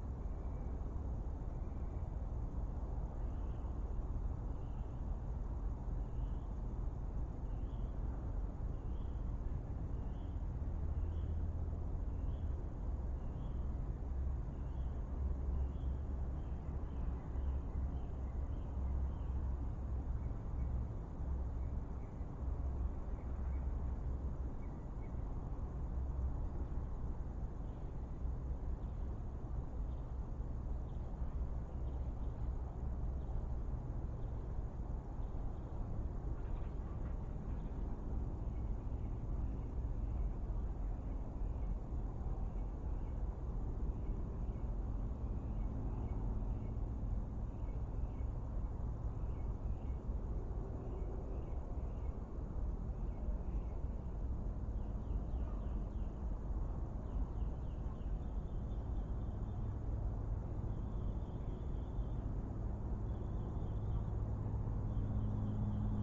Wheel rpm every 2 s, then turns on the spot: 0, 0, 0, 0, 0, 0, 0, 0, 0, 0, 0, 0, 0, 0, 0, 0, 0, 0, 0, 0, 0, 0, 0, 0, 0, 0, 0, 0, 0, 0, 0, 0, 0.
none